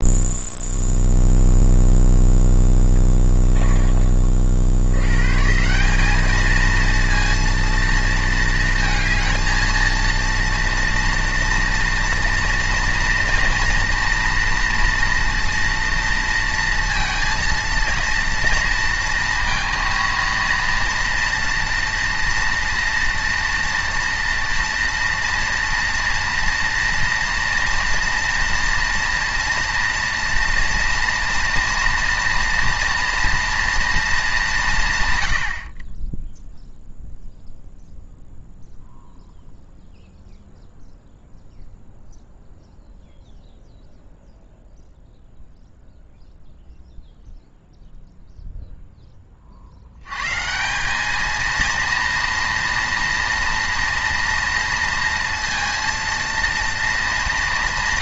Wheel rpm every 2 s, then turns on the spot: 0, 10, 80, 230, 230, 230, 230, 230, 230, 230, 230, 230, 230, 230, 230, 230, 230, 170, 0, 0, 0, 0, 0, 0, 0, 190, 230, 230, 230.
2-4